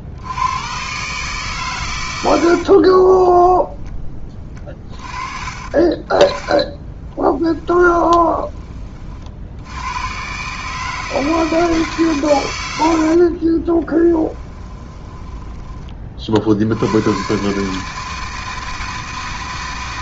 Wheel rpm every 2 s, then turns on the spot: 130, 40, 20, 20, 30, 150, 90, 20, 80, 160.
2-4 6-8 14-16